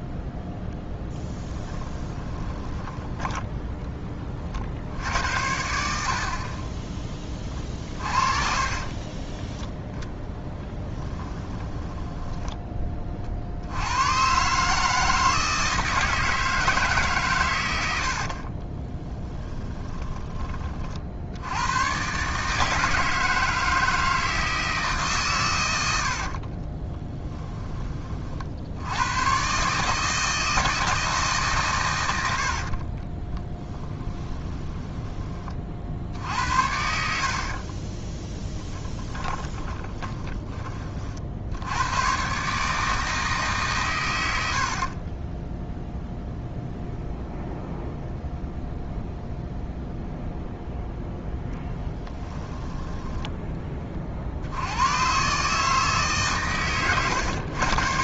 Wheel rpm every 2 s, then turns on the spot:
10, 20, 60, 20, 40, 10, 20, 150, 150, 30, 50, 160, 150, 30, 80, 160, 50, 10, 70, 10, 40, 150, 70, 0, 0, 0, 10, 100, 120.
2-4 6-12 18-20 26-28 32-40 52-54